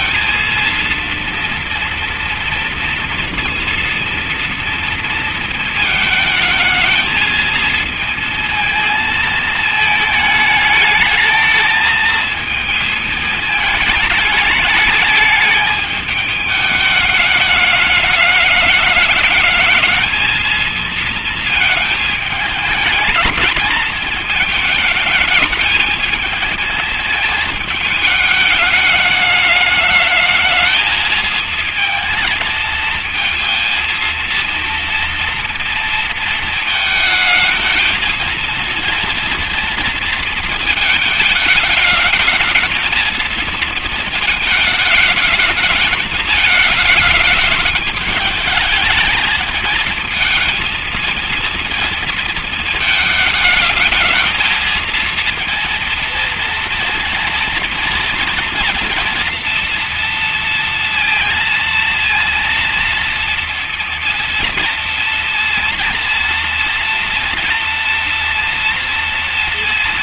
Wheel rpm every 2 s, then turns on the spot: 230, 230, 230, 220, 220, 220, 220, 210, 210, 210, 230, 210, 220, 220, 210, 220, 230, 230, 220, 230, 220, 220, 220, 210, 210, 220, 220, 220, 230, 230, 230, 230, 230, 230, 230.
none